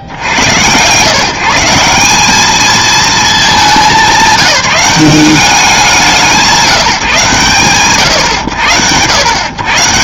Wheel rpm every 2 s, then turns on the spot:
70, 200, 200, 160, 110.
none